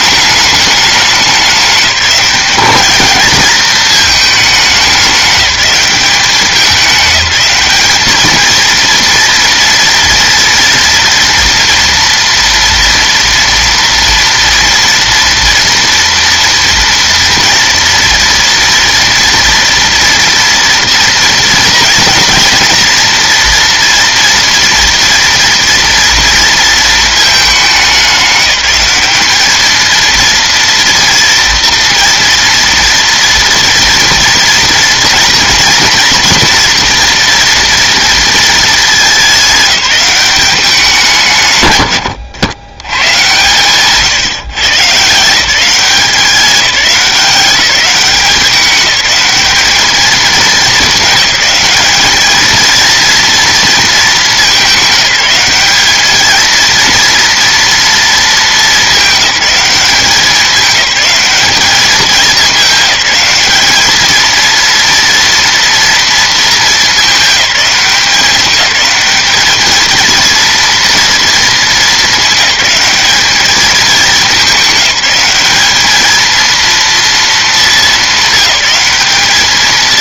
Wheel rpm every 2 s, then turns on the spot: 210, 220, 200, 200, 230, 230, 230, 230, 230, 230, 240, 230, 230, 220, 200, 230, 230, 230, 230, 210, 170, 110, 150, 190, 200, 210, 230, 190, 230, 210, 200, 210, 230, 210, 210, 230, 210, 210, 230, 210.
none